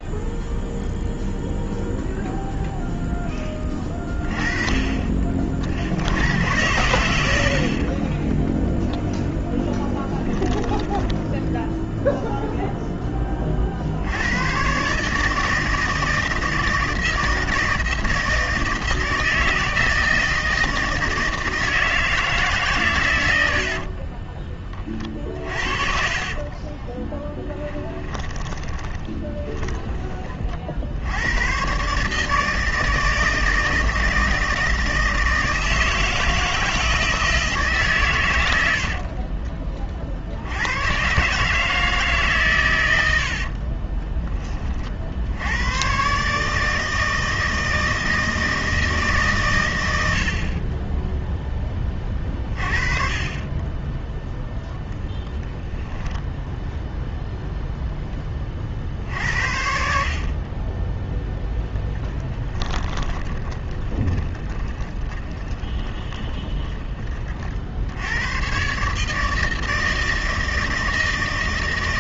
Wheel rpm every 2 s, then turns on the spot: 0, 0, 20, 100, 0, 10, 0, 120, 160, 160, 160, 140, 20, 20, 20, 50, 160, 160, 170, 80, 90, 120, 30, 150, 160, 40, 30, 0, 0, 40, 20, 20, 20, 20, 120, 160.
26-30 62-68